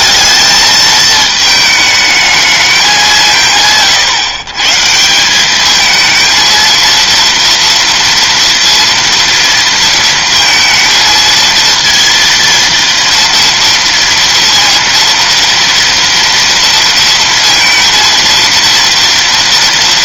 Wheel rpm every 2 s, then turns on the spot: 220, 200, 150, 230, 230, 230, 230, 230, 230, 230.
none